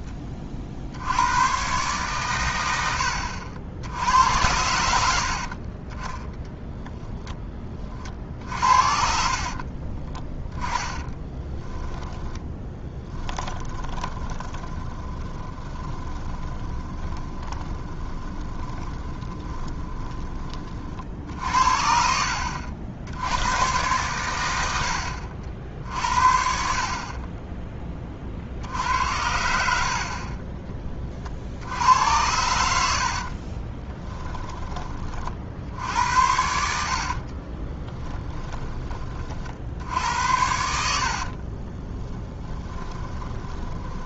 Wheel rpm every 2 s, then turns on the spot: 60, 90, 80, 10, 60, 10, 10, 30, 20, 20, 40, 80, 80, 50, 70, 30, 80, 20, 80, 20, 70, 20.
6-20 32-34 36-38 40-44